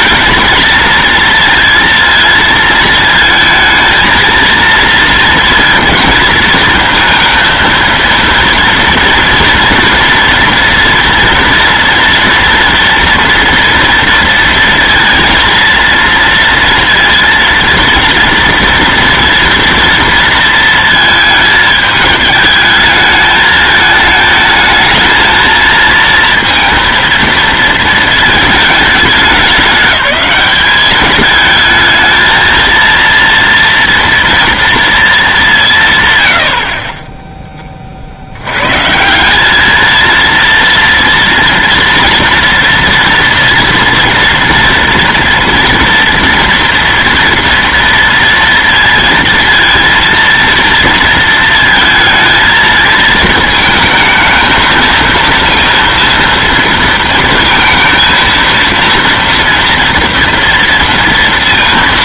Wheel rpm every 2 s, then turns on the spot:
230, 230, 230, 230, 230, 230, 230, 230, 230, 230, 230, 220, 220, 230, 220, 190, 220, 230, 90, 100, 230, 230, 240, 230, 230, 230, 220, 220, 230, 230, 230.
none